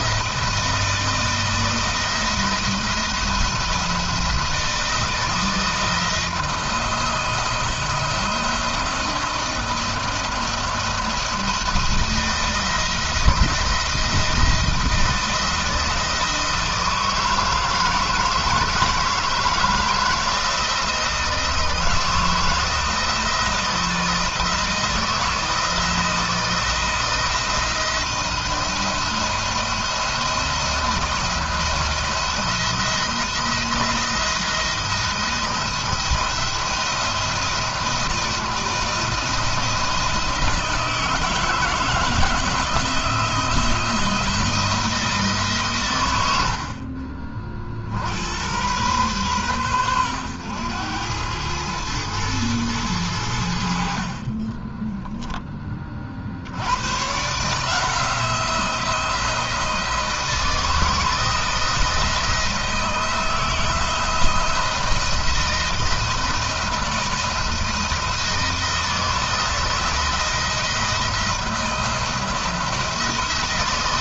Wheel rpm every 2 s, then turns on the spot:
160, 170, 170, 170, 170, 160, 160, 170, 160, 160, 170, 170, 160, 160, 170, 170, 170, 170, 170, 160, 160, 170, 160, 60, 110, 100, 100, 10, 110, 170, 170, 160, 170, 170, 160, 170, 170.
54-56